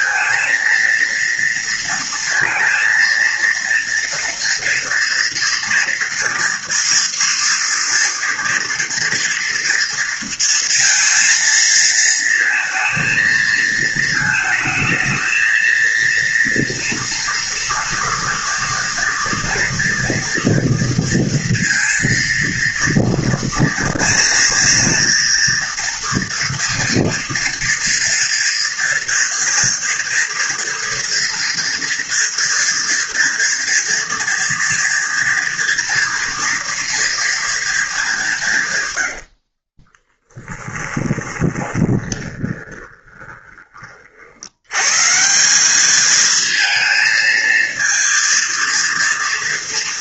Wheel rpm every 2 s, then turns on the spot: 230, 230, 230, 230, 240, 230, 220, 220, 230, 230, 240, 230, 230, 230, 230, 230, 230, 230, 230, 150, 10, 20, 90, 220, 230.
40-44